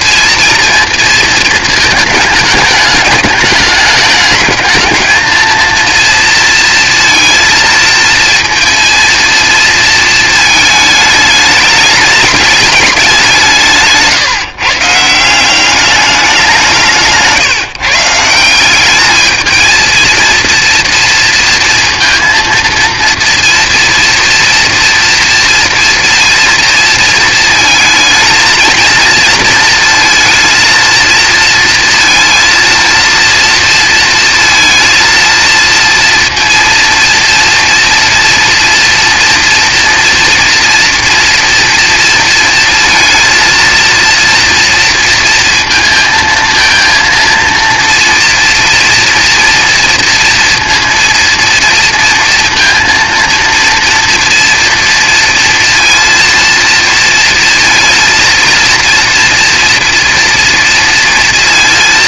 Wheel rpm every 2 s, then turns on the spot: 230, 210, 220, 230, 230, 220, 210, 150, 170, 200, 230, 230, 230, 230, 230, 220, 230, 220, 230, 230, 230, 230, 230, 220, 240, 230, 230, 230, 230, 230, 230.
none